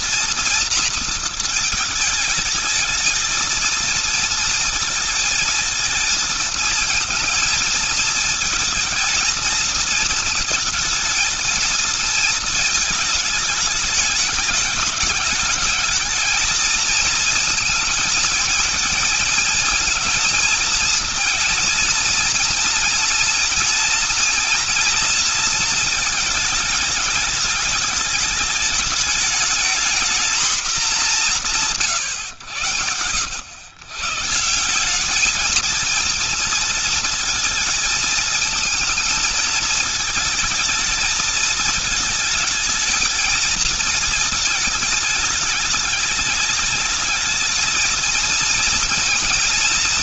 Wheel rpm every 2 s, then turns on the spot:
230, 220, 230, 220, 220, 220, 220, 210, 230, 230, 230, 230, 240, 220, 210, 220, 100, 180, 230, 220, 220, 220, 220, 210, 230.
none